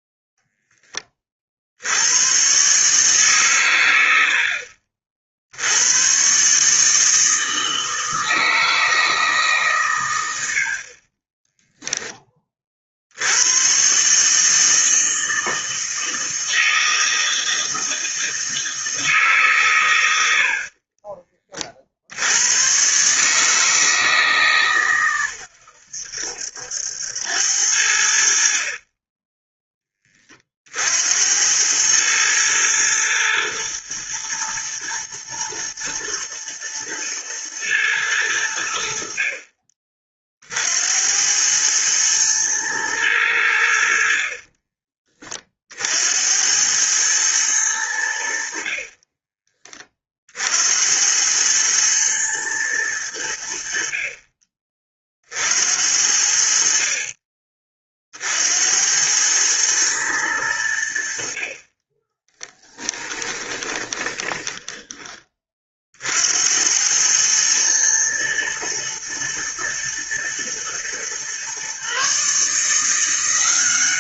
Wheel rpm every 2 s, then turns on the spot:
0, 130, 50, 140, 160, 70, 30, 160, 160, 160, 70, 110, 140, 80, 50, 50, 110, 120, 120, 90, 60, 110, 40, 90, 50, 70, 110, 30, 60, 70, 90, 20, 20, 80, 110, 120, 150.
20-22 62-66